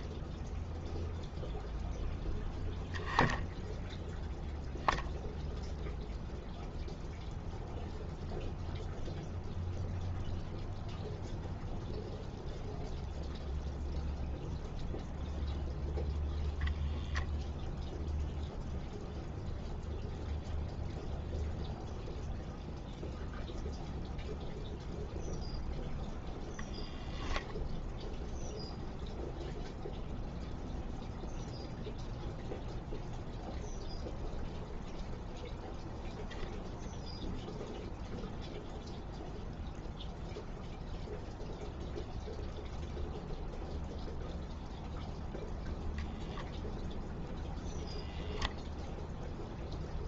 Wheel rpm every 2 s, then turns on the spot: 0, 0, 0, 0, 0, 0, 0, 0, 0, 0, 0, 0, 0, 0, 0, 0, 0, 0, 0, 0, 0, 0, 0, 0, 0.
none